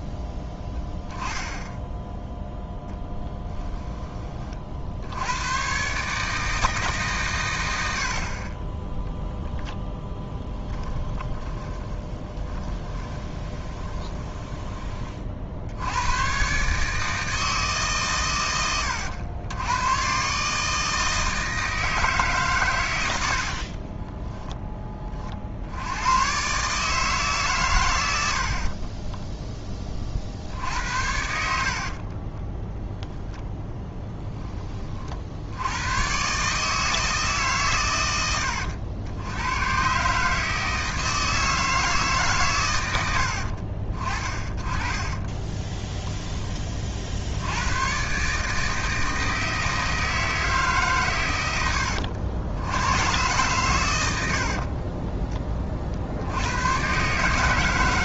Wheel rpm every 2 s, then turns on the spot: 0, 10, 60, 150, 10, 20, 20, 20, 140, 100, 150, 110, 20, 150, 40, 70, 0, 30, 160, 90, 160, 110, 20, 40, 160, 140, 100, 30, 100.
10-14 28-30 44-46 54-56